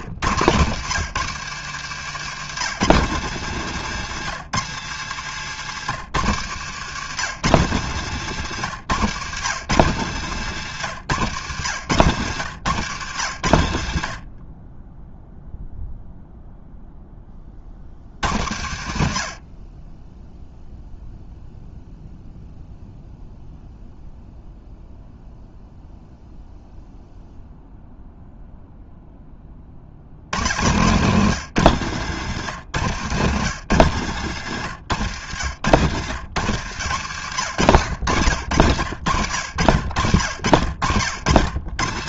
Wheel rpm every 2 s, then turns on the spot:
130, 160, 130, 130, 140, 130, 110, 20, 0, 80, 0, 0, 0, 0, 0, 120, 130, 110, 110, 80, 70.
34-36